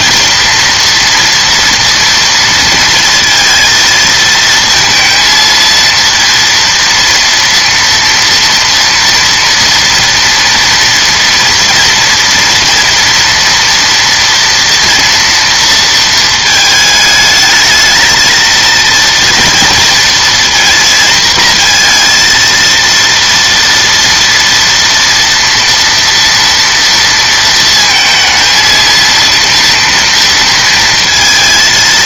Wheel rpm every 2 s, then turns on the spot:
230, 230, 230, 230, 230, 230, 240, 230, 220, 230, 230, 230, 230, 230, 230, 230.
none